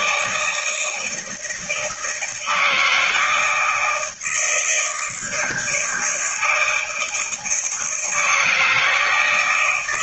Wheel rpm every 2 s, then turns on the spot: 160, 160, 160, 160, 150.
none